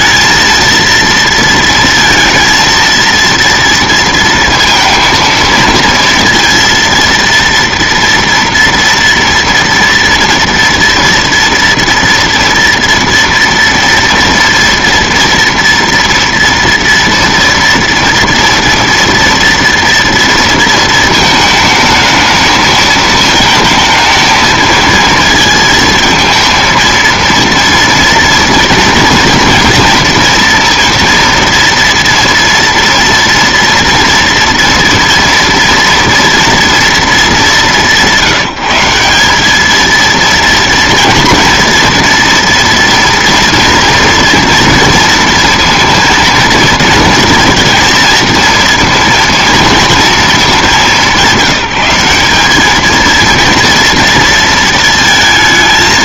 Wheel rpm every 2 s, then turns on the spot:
230, 230, 230, 230, 240, 230, 230, 230, 230, 230, 230, 220, 220, 230, 230, 230, 230, 230, 240, 180, 230, 240, 230, 230, 230, 220, 210, 230.
none